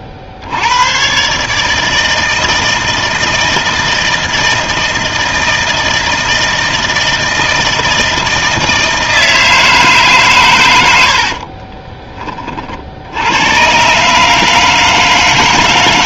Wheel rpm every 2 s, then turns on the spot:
80, 160, 160, 160, 160, 110, 50, 160.
none